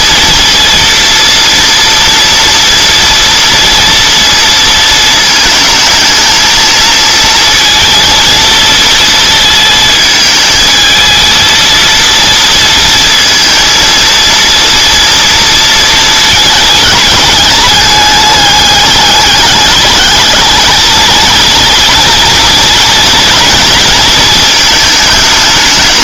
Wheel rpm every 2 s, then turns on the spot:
230, 230, 230, 220, 230, 220, 230, 230, 220, 210, 220, 230, 230.
none